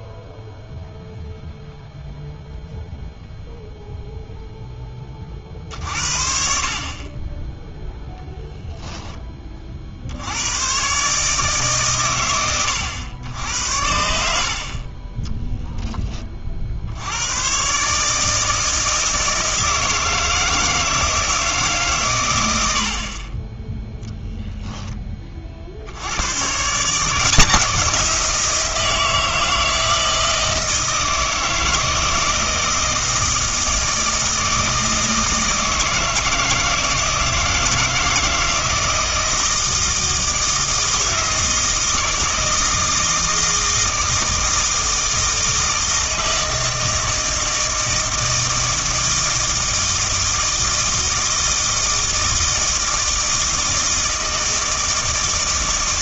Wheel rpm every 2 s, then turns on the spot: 0, 0, 0, 50, 0, 100, 100, 50, 50, 160, 160, 100, 10, 140, 170, 160, 160, 160, 160, 160, 160, 160, 160, 160, 160, 160, 160, 160.
none